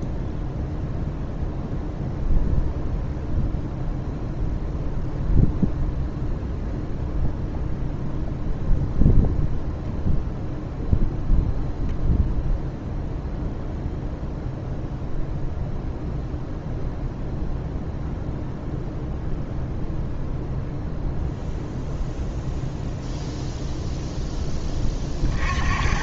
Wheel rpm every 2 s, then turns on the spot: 0, 0, 0, 0, 0, 0, 0, 0, 0, 0, 0, 0, 20.
none